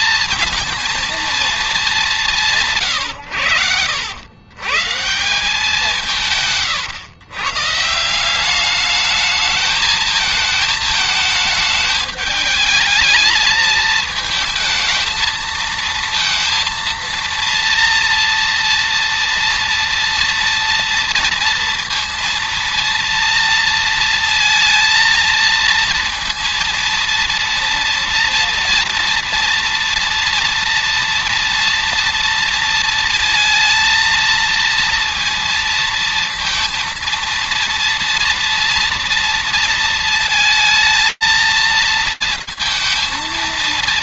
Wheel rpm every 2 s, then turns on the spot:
230, 120, 150, 130, 210, 220, 220, 220, 230, 230, 230, 230, 230, 230, 230, 230, 230, 230, 230, 230, 220, 230.
none